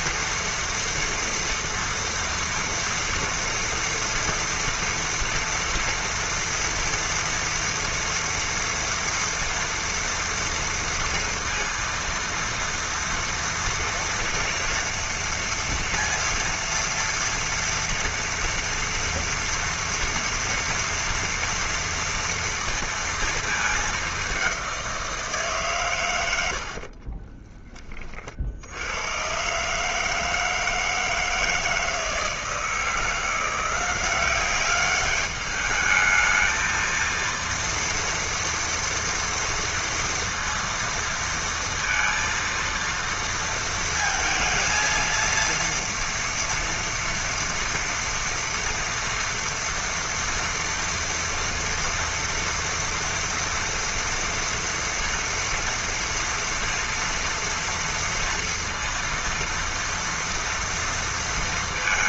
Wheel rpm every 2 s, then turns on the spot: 230, 230, 230, 230, 230, 230, 230, 230, 230, 230, 230, 230, 180, 30, 100, 160, 170, 200, 230, 230, 230, 230, 230, 230, 230, 240, 230, 230, 230, 230, 230.
26-28